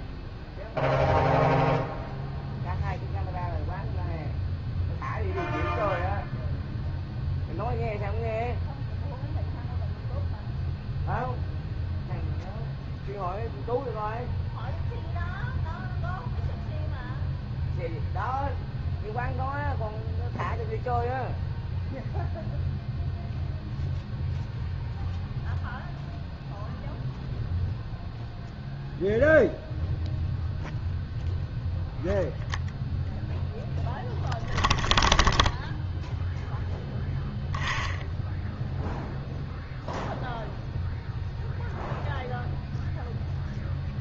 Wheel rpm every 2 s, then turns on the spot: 0, 0, 0, 0, 0, 0, 0, 0, 0, 0, 0, 0, 0, 0, 0, 0, 0, 0, 0, 0, 0, 0.
none